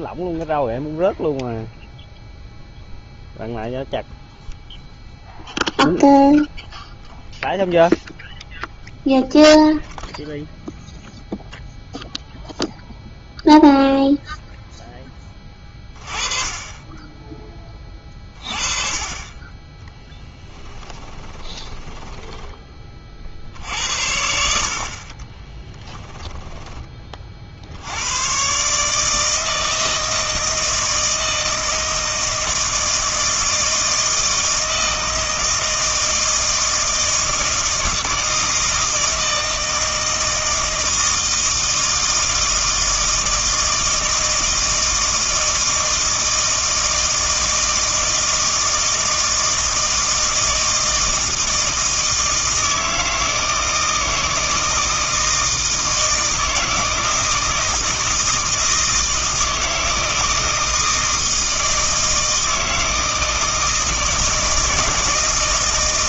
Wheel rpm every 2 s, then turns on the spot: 0, 0, 0, 0, 0, 0, 0, 0, 20, 40, 20, 20, 60, 20, 140, 160, 160, 160, 160, 160, 160, 160, 160, 160, 160, 160, 160, 160, 160, 160, 160, 160, 160.
20-22